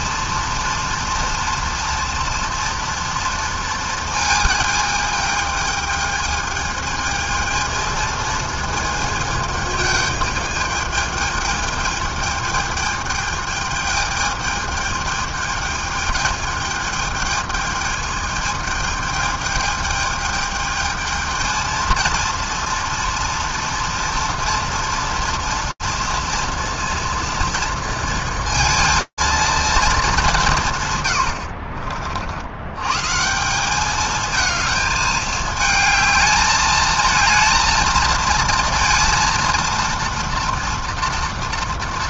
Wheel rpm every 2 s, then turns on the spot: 230, 230, 220, 220, 220, 210, 220, 210, 210, 210, 220, 230, 230, 230, 230, 170, 90, 220, 220, 230, 240.
none